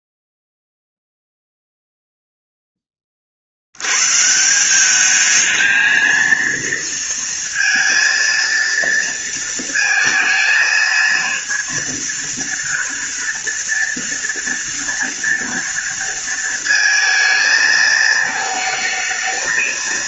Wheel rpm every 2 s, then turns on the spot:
0, 10, 170, 230, 230, 230, 230, 230, 230, 220.
none